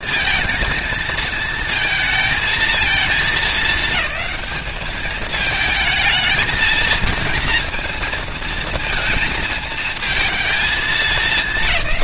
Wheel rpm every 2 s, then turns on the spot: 230, 220, 210, 230, 230, 220.
none